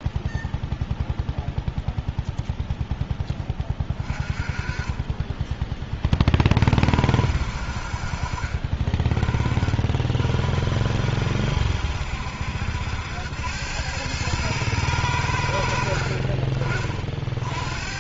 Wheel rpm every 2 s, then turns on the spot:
0, 0, 20, 40, 40, 50, 70, 110, 40.
none